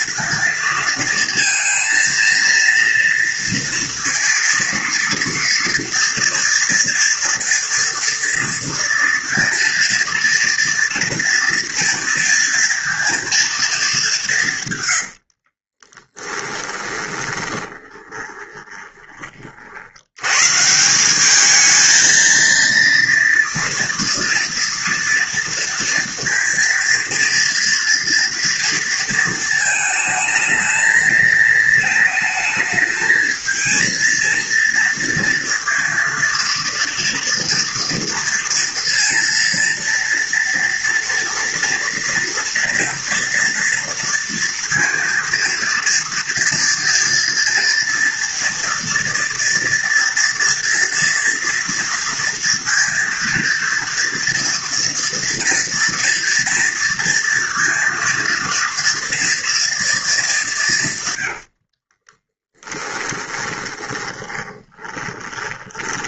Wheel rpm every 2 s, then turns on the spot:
230, 230, 230, 230, 230, 230, 240, 140, 20, 20, 130, 230, 230, 230, 230, 220, 220, 230, 230, 230, 230, 230, 230, 230, 230, 230, 230, 230, 230, 230, 190, 10, 10.
14-20 62-66